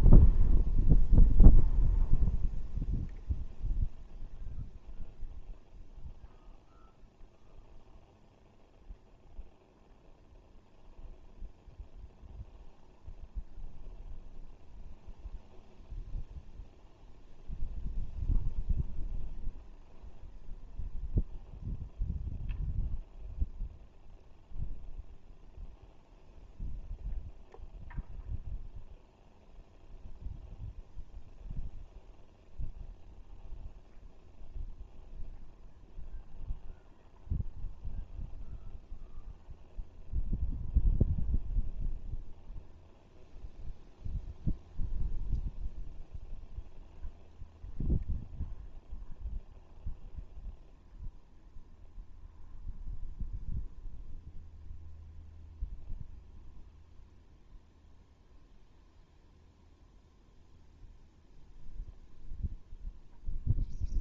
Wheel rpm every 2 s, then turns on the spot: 0, 0, 0, 0, 0, 0, 0, 0, 0, 0, 0, 0, 0, 0, 0, 0, 0, 0, 0, 0, 0, 0, 0, 0, 0, 0, 0, 0, 0, 0, 0, 0.
none